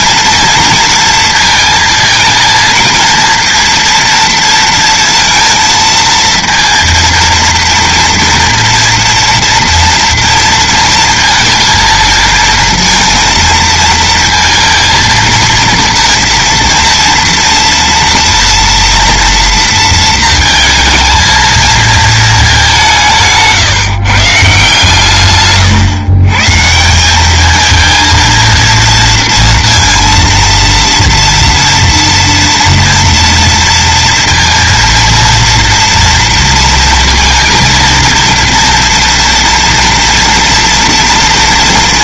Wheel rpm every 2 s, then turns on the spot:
230, 230, 230, 230, 230, 230, 230, 230, 230, 240, 230, 200, 150, 150, 230, 230, 230, 230, 230, 230, 230.
none